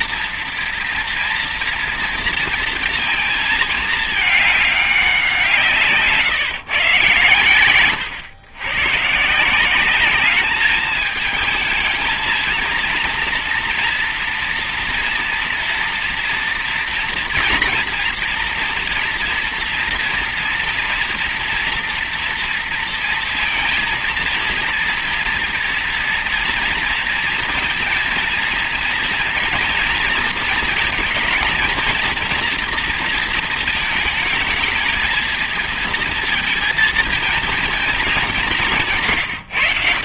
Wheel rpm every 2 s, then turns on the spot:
230, 230, 200, 140, 140, 220, 230, 230, 230, 230, 230, 230, 230, 230, 230, 230, 230, 220, 230, 150.
none